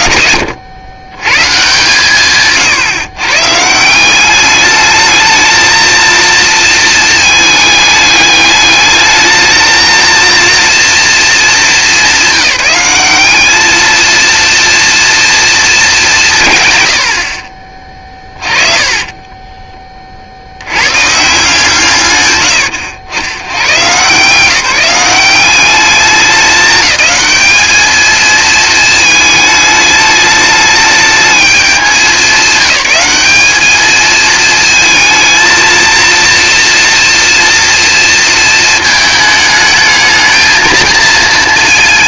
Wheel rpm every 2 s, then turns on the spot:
140, 150, 230, 210, 220, 200, 220, 230, 40, 20, 150, 80, 190, 210, 220, 210, 200, 230, 230, 210, 230.
18-20